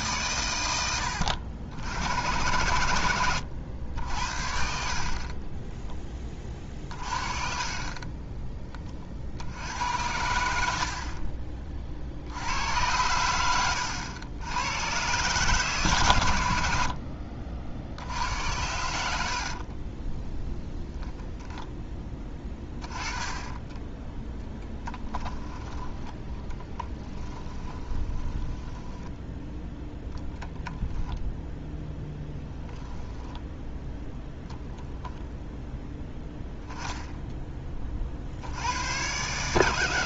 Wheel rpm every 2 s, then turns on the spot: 90, 100, 40, 40, 30, 60, 100, 110, 60, 90, 0, 10, 0, 10, 10, 0, 10, 0, 0, 100.
6-8 22-24 26-28 32-34